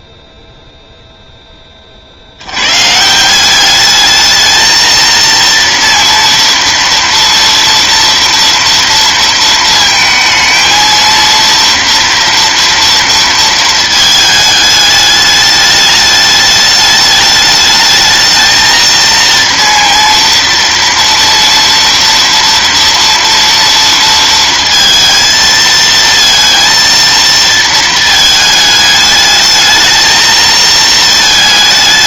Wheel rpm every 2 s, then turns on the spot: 0, 130, 230, 230, 230, 230, 230, 210, 210, 230, 240, 230, 230, 230, 210, 220.
none